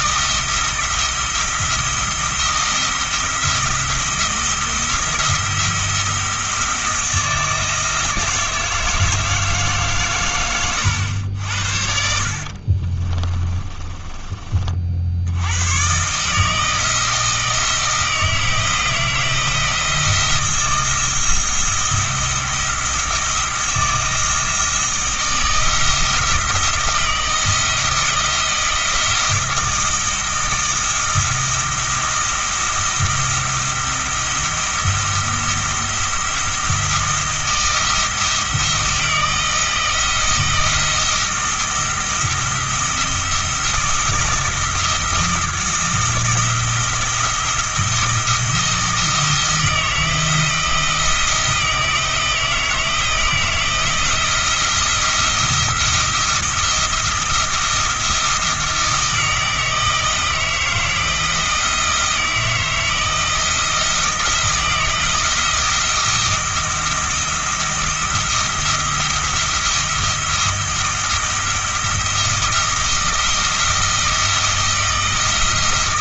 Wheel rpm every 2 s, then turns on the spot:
170, 170, 170, 160, 160, 100, 50, 50, 160, 160, 170, 170, 160, 170, 170, 170, 170, 170, 170, 170, 160, 170, 160, 160, 160, 160, 160, 170, 170, 170, 160, 160, 170, 170, 160, 160, 170, 160.
12-14